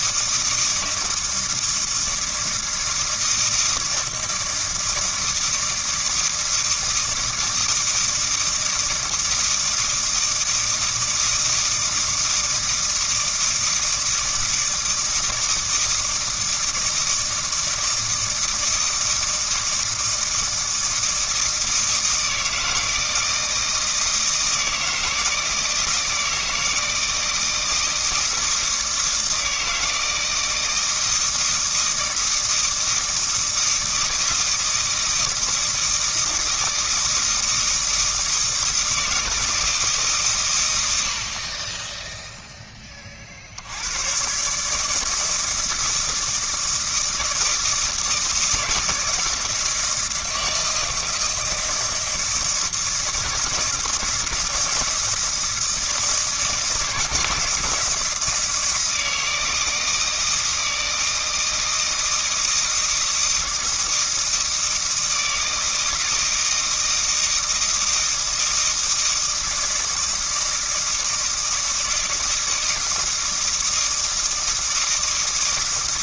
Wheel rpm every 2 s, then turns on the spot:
160, 160, 160, 160, 160, 160, 160, 160, 160, 160, 160, 160, 160, 160, 160, 160, 160, 160, 160, 160, 90, 30, 160, 160, 160, 160, 160, 160, 160, 160, 160, 160, 160, 160, 160, 160, 160, 160.
none